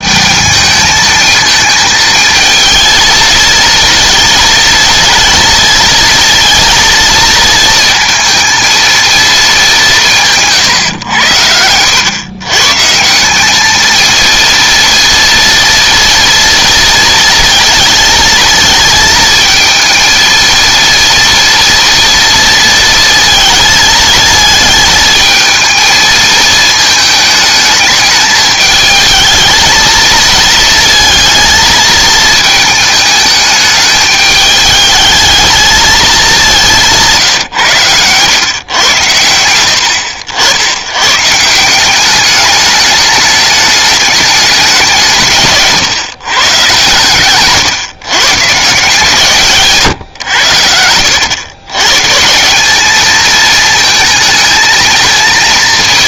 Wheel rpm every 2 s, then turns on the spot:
220, 220, 220, 230, 230, 130, 140, 230, 230, 230, 230, 230, 220, 220, 210, 220, 220, 210, 180, 120, 90, 210, 180, 130, 160, 90, 190, 220.
36-38